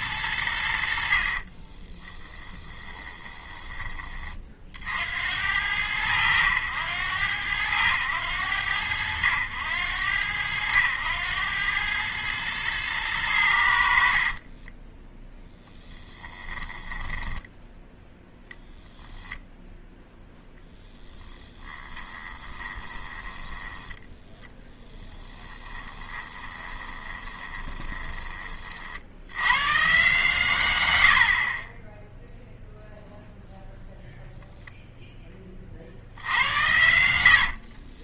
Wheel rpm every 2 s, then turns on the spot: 90, 20, 40, 100, 90, 90, 110, 20, 10, 0, 0, 10, 10, 20, 40, 130, 0, 0, 90.
2-4 14-18 22-28